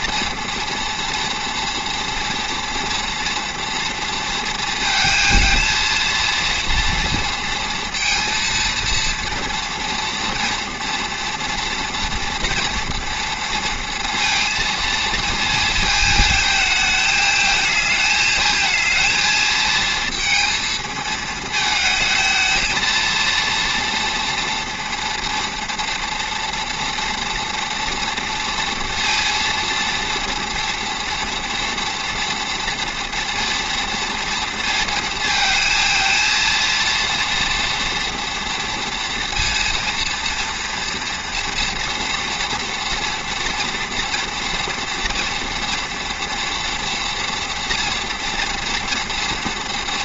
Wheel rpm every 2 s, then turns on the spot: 230, 230, 230, 230, 230, 240, 240, 230, 220, 220, 230, 220, 230, 230, 230, 230, 230, 230, 230, 230, 230, 230, 230, 230, 230.
none